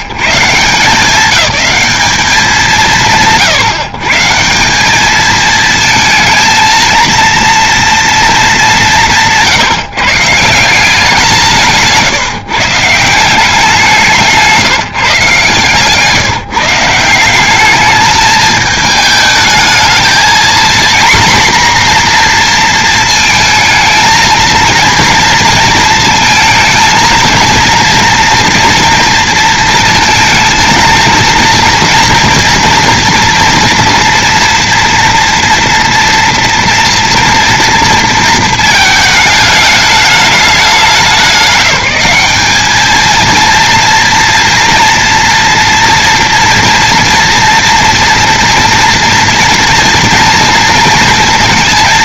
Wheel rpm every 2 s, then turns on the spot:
130, 160, 170, 230, 210, 170, 150, 160, 160, 210, 230, 240, 230, 220, 230, 230, 230, 240, 240, 230, 210, 210, 230, 230, 240, 230.
none